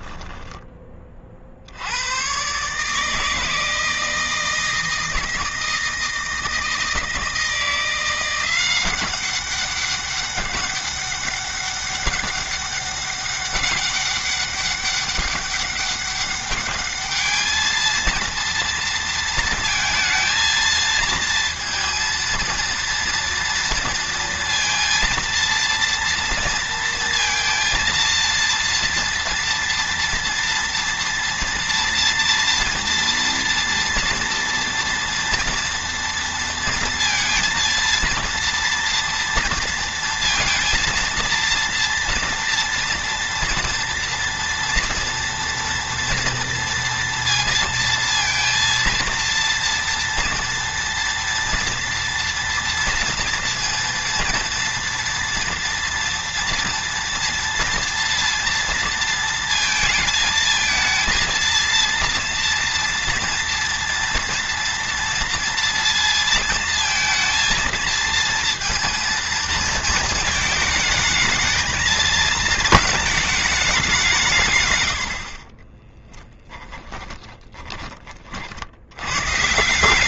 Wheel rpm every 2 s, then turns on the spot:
20, 140, 160, 160, 190, 200, 200, 200, 210, 230, 230, 230, 230, 230, 230, 230, 230, 230, 230, 230, 230, 240, 240, 230, 230, 230, 230, 230, 230, 230, 230, 230, 230, 230, 230, 220, 220, 110, 10, 90.
76-78